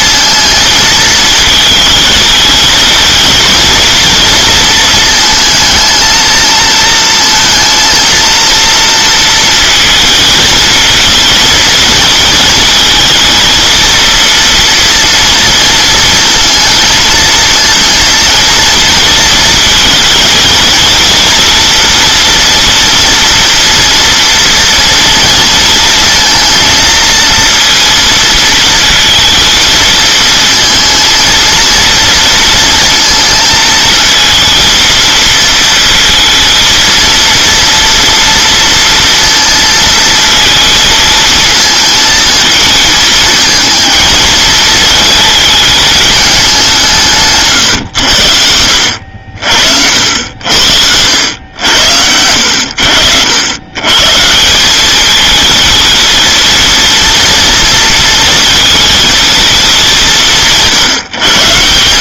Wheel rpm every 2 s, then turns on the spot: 230, 220, 230, 230, 230, 230, 230, 230, 230, 230, 230, 230, 230, 230, 230, 230, 230, 230, 230, 230, 220, 220, 220, 190, 80, 80, 90, 200, 230, 230, 160.
none